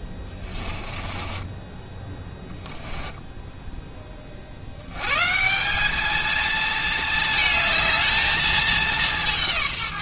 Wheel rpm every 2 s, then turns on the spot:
20, 10, 80, 220, 210.
0-4